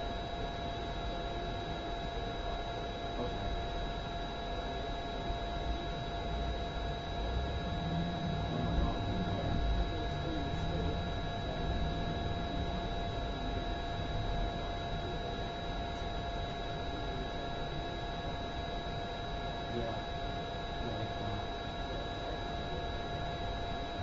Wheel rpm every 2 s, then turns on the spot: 0, 0, 0, 0, 0, 0, 0, 0, 0, 0, 0, 0.
none